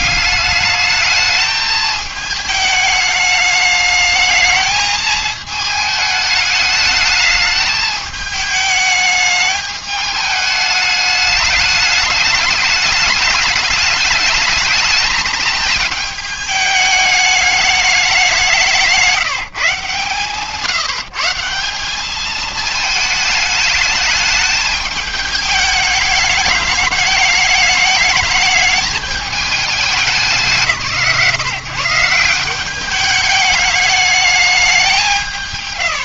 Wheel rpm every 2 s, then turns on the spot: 210, 210, 220, 210, 210, 210, 210, 220, 210, 180, 150, 220, 210, 210, 210, 160, 180, 210.
none